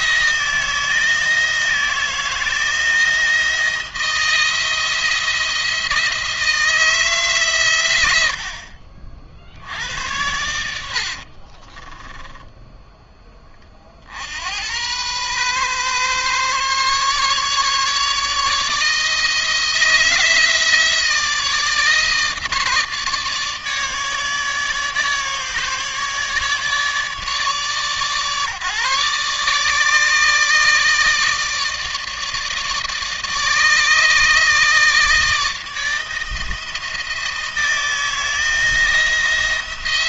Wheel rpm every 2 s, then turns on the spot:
160, 160, 170, 160, 80, 80, 10, 90, 140, 150, 160, 150, 150, 150, 140, 150, 160, 160, 170, 170.
none